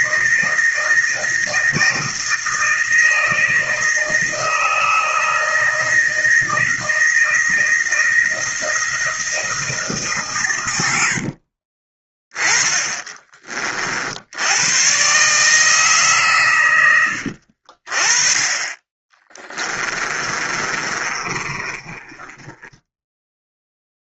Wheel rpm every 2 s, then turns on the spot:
160, 160, 160, 160, 160, 90, 20, 100, 110, 30, 30, 10.
12-14 20-24